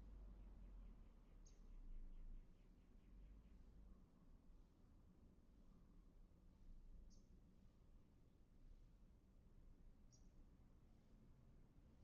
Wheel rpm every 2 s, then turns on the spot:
0, 0, 0, 0, 0, 0.
none